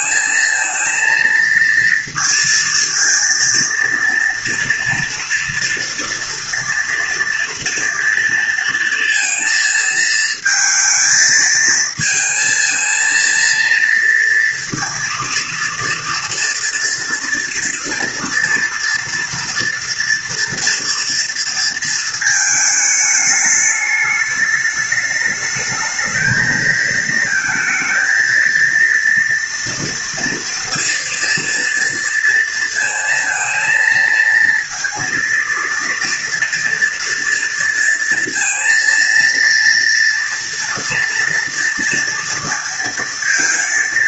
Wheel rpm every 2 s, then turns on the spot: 230, 230, 230, 230, 220, 220, 230, 230, 230, 240, 230, 210, 210, 230, 230, 230, 230, 230, 230, 230, 230, 230.
none